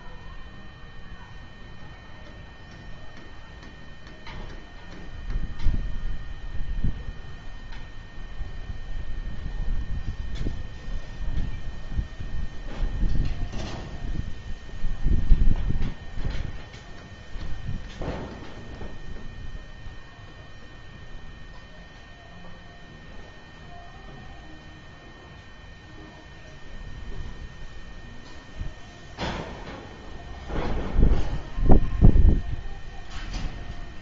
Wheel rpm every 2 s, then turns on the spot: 0, 0, 0, 0, 0, 0, 0, 0, 0, 0, 0, 0, 0, 0, 0, 0, 0.
none